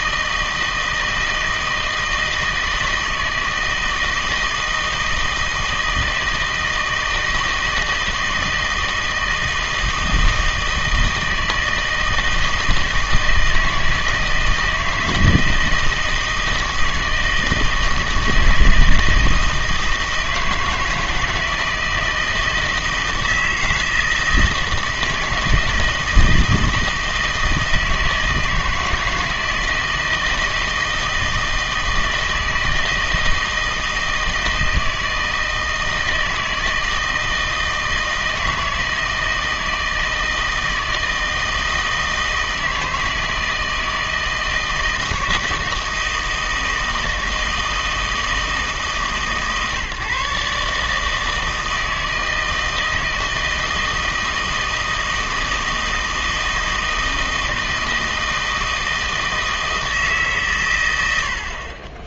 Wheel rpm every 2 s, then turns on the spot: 160, 160, 160, 160, 160, 160, 160, 170, 160, 160, 160, 160, 170, 160, 160, 160, 160, 160, 160, 160, 160, 160, 160, 160, 160, 150, 160, 160, 160, 160, 120.
none